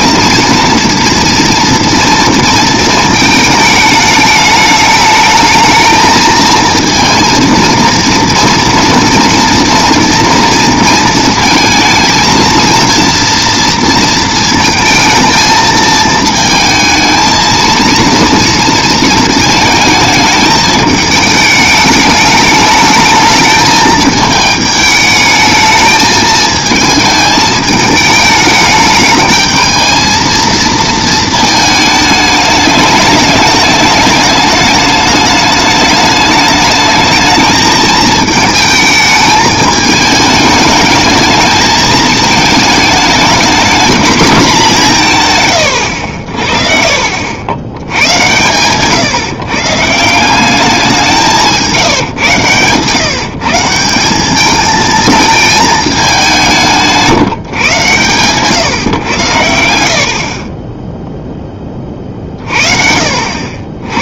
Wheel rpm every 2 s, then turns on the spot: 230, 230, 210, 220, 230, 230, 230, 230, 220, 230, 210, 210, 220, 220, 210, 230, 210, 210, 210, 220, 210, 220, 210, 60, 130, 190, 130, 210, 170, 130, 30, 40.
none